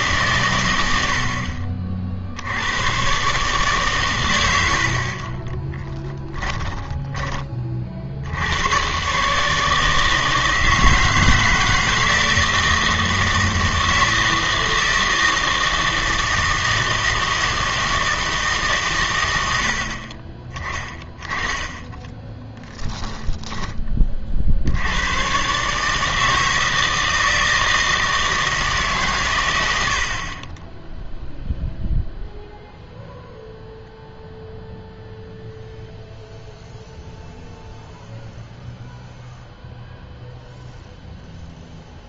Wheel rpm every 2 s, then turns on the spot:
60, 130, 40, 20, 140, 160, 160, 160, 160, 110, 10, 10, 110, 160, 120, 0, 0, 0, 0, 0, 0.
none